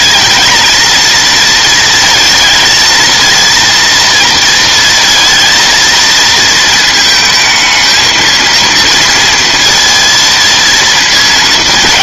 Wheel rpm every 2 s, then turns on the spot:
220, 230, 230, 220, 220, 230.
none